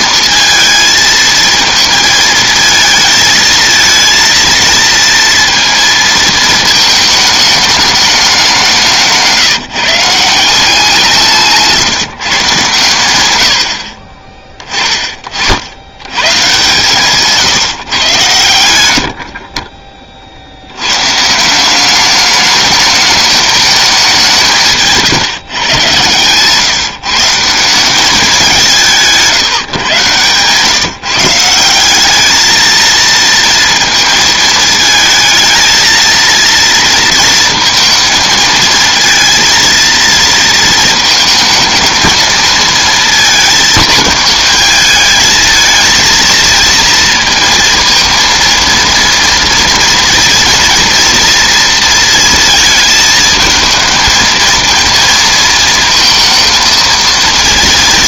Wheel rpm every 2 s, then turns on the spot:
220, 220, 230, 220, 180, 180, 130, 30, 140, 100, 70, 210, 160, 150, 190, 140, 220, 220, 230, 220, 230, 220, 210, 230, 230, 230, 220, 220, 230.
none